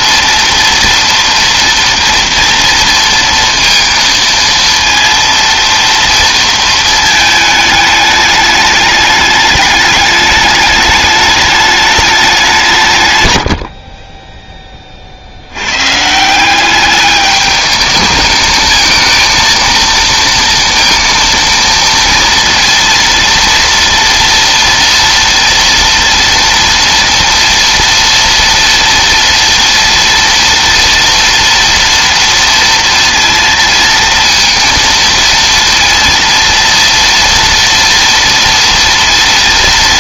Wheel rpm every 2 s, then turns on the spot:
230, 230, 230, 230, 210, 210, 160, 20, 190, 220, 230, 230, 230, 230, 230, 230, 230, 230, 230, 230.
none